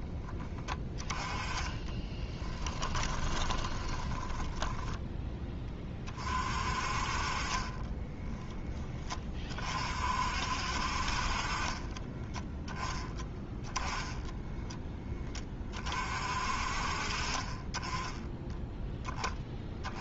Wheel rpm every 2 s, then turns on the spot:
10, 10, 10, 40, 20, 50, 10, 10, 50, 10.
2-6